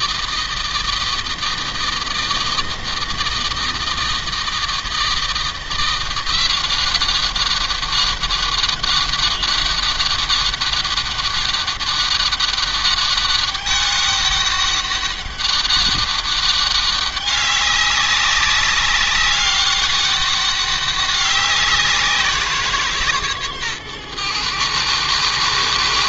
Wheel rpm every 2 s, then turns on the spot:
160, 160, 160, 180, 200, 200, 200, 200, 200, 200, 200, 160, 110.
none